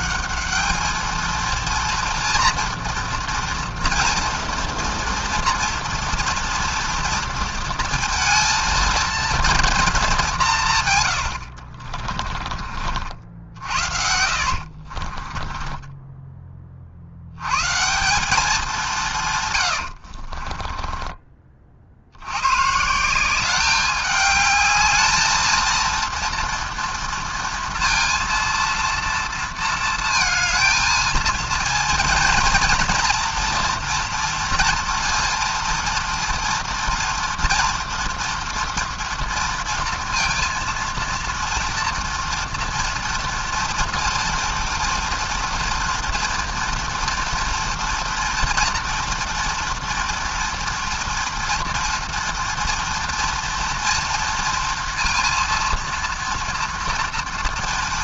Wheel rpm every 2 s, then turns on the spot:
220, 230, 230, 230, 230, 130, 50, 50, 50, 200, 20, 150, 210, 230, 230, 220, 230, 230, 230, 240, 230, 230, 230, 230, 230, 230, 230, 230, 230.
14-16 20-22